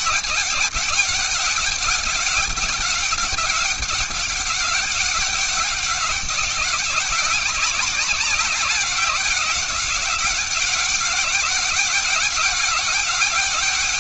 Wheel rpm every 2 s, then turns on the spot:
200, 200, 200, 190, 190, 190, 200.
none